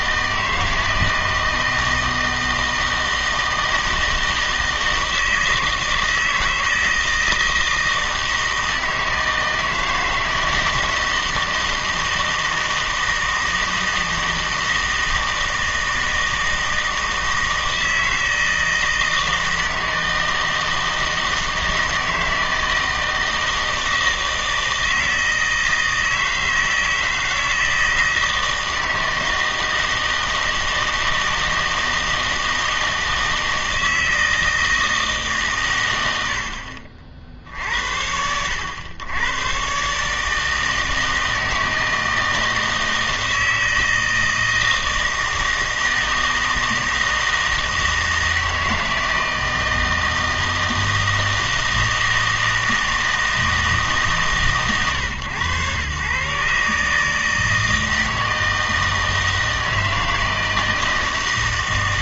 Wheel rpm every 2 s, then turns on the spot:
160, 160, 160, 160, 160, 160, 160, 160, 160, 160, 160, 160, 160, 160, 160, 160, 160, 160, 60, 90, 160, 160, 160, 160, 160, 160, 160, 140, 140, 160, 160.
none